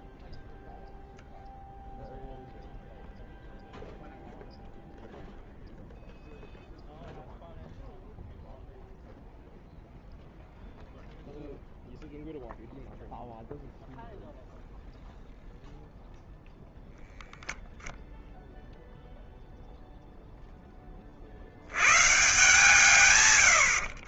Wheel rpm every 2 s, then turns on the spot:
0, 0, 0, 0, 0, 0, 0, 0, 0, 0, 100, 70.
22-24